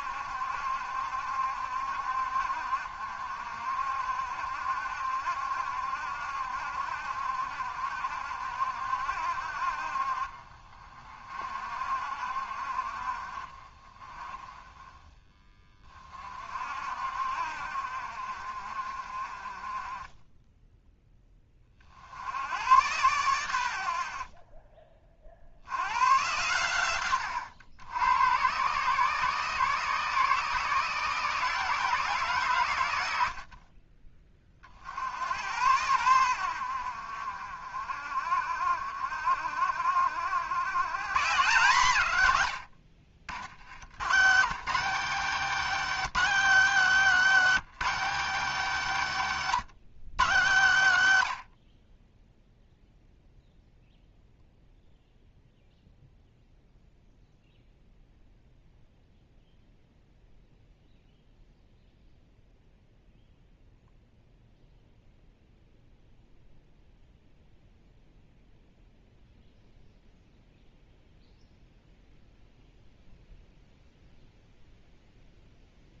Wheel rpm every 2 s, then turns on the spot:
70, 60, 70, 70, 70, 40, 50, 20, 50, 50, 10, 110, 30, 120, 130, 160, 110, 40, 70, 60, 110, 100, 180, 220, 210, 130, 0, 0, 0, 0, 0, 0, 0, 0, 0, 0, 0, 0.
24-26